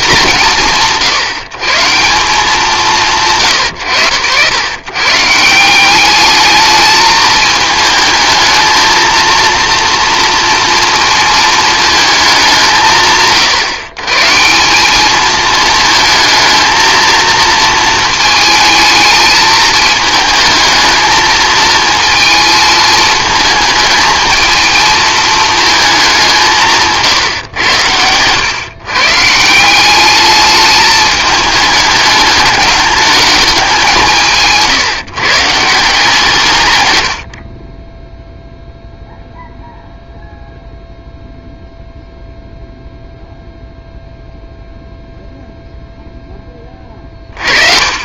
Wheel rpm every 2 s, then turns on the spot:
180, 180, 100, 210, 220, 230, 180, 170, 230, 220, 220, 220, 220, 170, 130, 210, 210, 150, 120, 0, 0, 0, 0, 20.
none